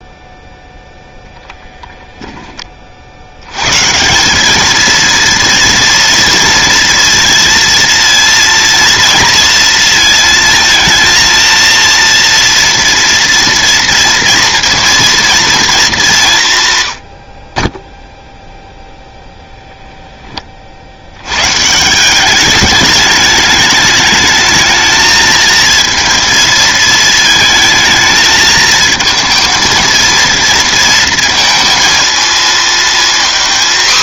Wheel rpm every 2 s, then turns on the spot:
0, 30, 220, 230, 230, 230, 230, 230, 140, 0, 30, 200, 220, 220, 220, 230, 230.
none